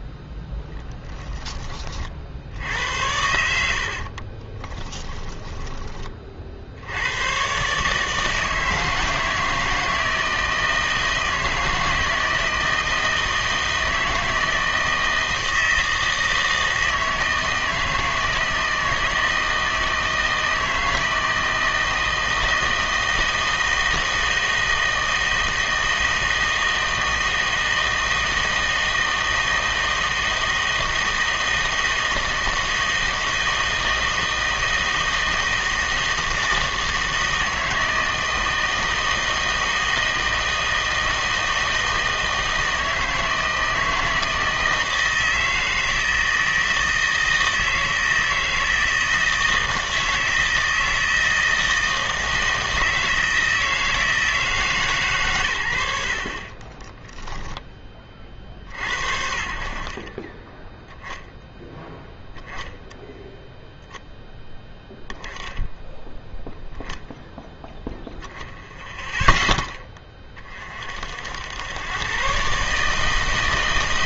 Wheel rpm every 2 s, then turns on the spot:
10, 80, 20, 70, 160, 160, 160, 160, 160, 160, 160, 160, 160, 160, 160, 160, 160, 160, 160, 160, 160, 160, 160, 160, 160, 160, 160, 150, 30, 60, 10, 0, 10, 0, 0, 40, 140.
4-6 56-58